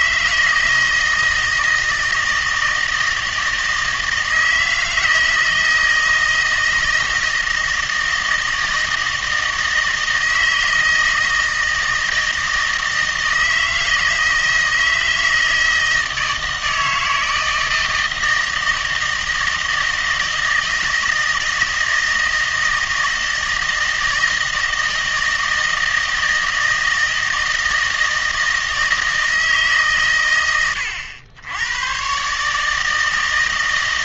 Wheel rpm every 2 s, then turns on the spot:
160, 160, 160, 160, 160, 160, 160, 160, 160, 160, 160, 160, 160, 160, 160, 100, 150.
none